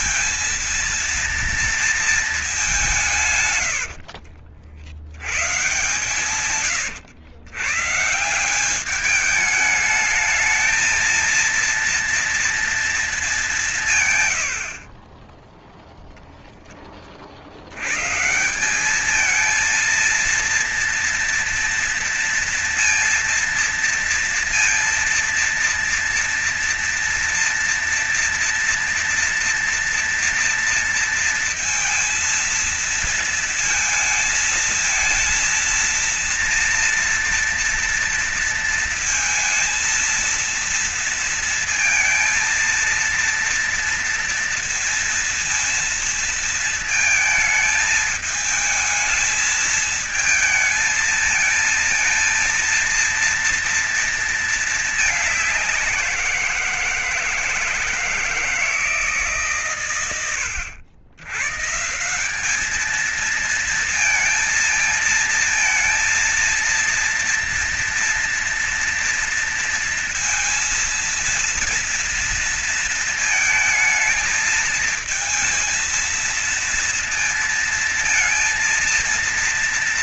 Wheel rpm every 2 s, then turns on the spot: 220, 220, 70, 120, 150, 220, 230, 120, 0, 130, 230, 230, 230, 230, 230, 230, 220, 230, 230, 230, 230, 230, 230, 230, 220, 220, 230, 230, 180, 150, 110, 170, 230, 230, 230, 230, 230, 220, 230, 230.
6-8